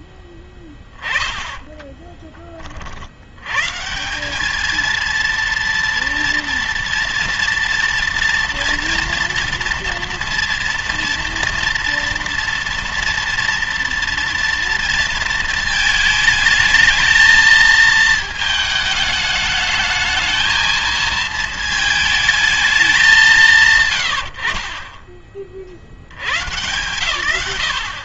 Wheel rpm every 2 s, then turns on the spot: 10, 30, 200, 230, 230, 230, 230, 230, 220, 220, 220, 210, 60, 120.
none